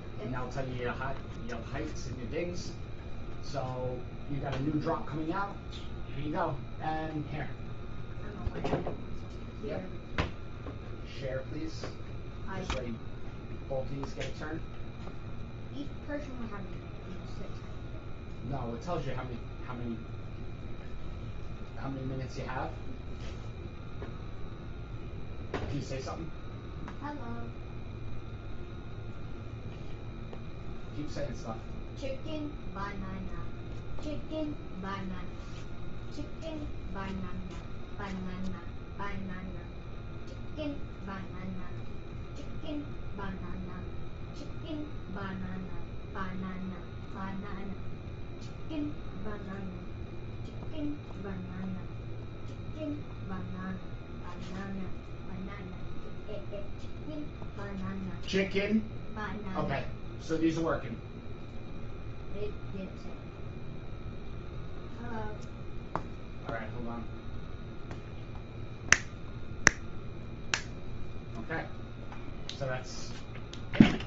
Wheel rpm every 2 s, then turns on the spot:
0, 0, 0, 0, 0, 0, 0, 0, 0, 0, 0, 0, 0, 0, 0, 0, 0, 0, 0, 0, 0, 0, 0, 0, 0, 0, 0, 0, 0, 0, 0, 0, 0, 0, 0, 0, 0.
none